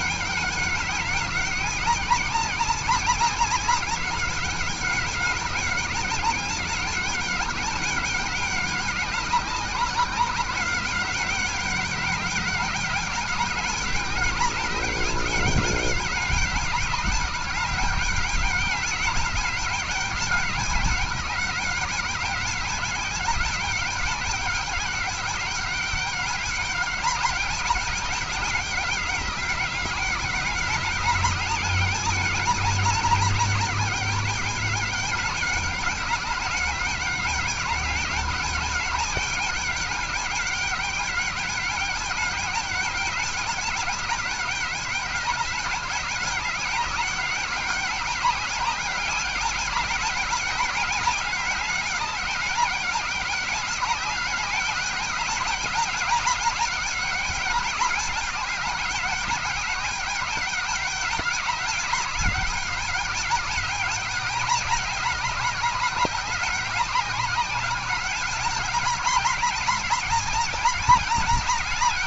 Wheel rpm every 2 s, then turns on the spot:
200, 190, 190, 200, 200, 190, 200, 200, 200, 200, 200, 200, 200, 200, 190, 200, 200, 200, 200, 200, 200, 200, 190, 190, 200, 200, 200, 200, 200, 190, 200, 200, 200, 190, 200, 200.
none